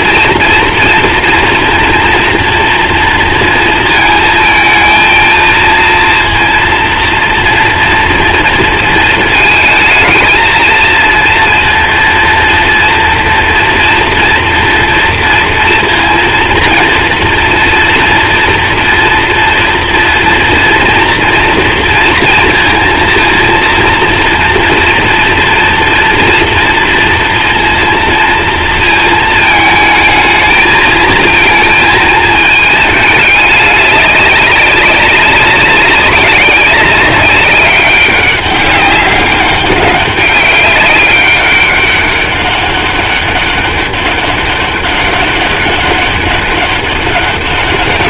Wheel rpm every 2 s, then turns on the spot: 230, 230, 220, 230, 230, 230, 240, 230, 230, 230, 230, 230, 230, 230, 230, 220, 220, 200, 190, 190, 200, 200, 200, 200.
none